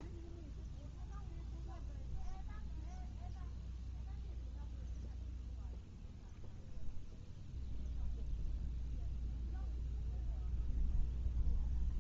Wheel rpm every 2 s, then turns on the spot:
0, 0, 0, 0, 0, 0.
none